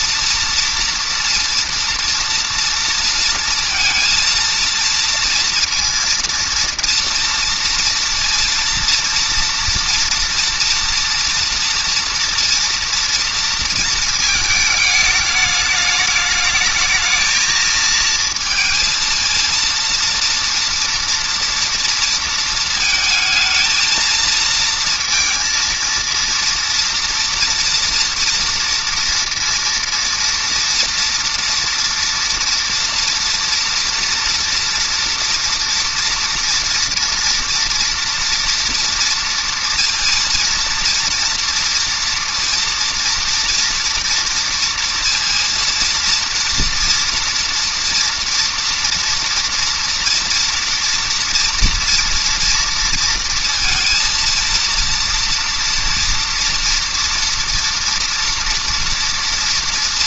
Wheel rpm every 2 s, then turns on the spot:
230, 230, 230, 230, 230, 240, 230, 220, 210, 230, 230, 230, 220, 230, 230, 230, 230, 230, 230, 230, 230, 230, 230, 230, 230, 230, 230, 230, 230, 230.
none